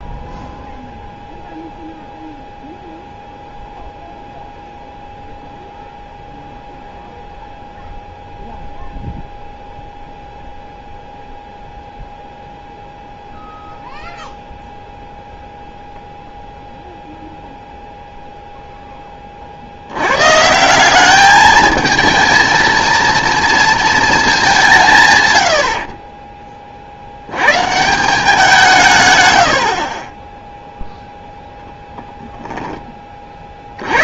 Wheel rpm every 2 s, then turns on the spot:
0, 0, 0, 0, 0, 0, 0, 0, 0, 0, 170, 220, 170, 40, 160, 0, 10.
none